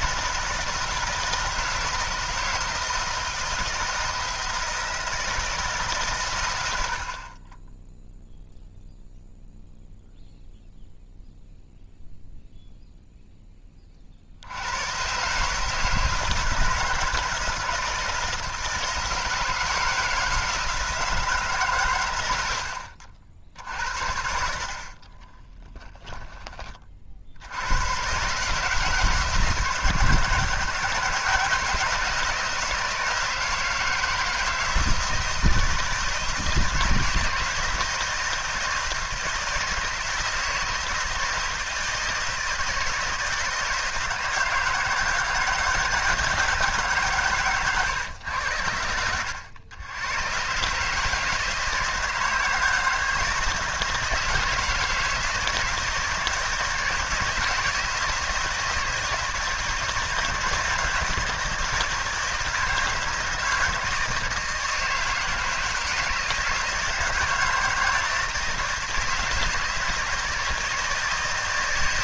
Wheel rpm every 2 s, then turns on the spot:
160, 160, 160, 80, 0, 0, 0, 110, 160, 160, 160, 80, 40, 40, 160, 160, 160, 160, 160, 160, 160, 160, 160, 150, 90, 140, 160, 160, 160, 160, 160, 160, 160, 160, 160, 160.
22-26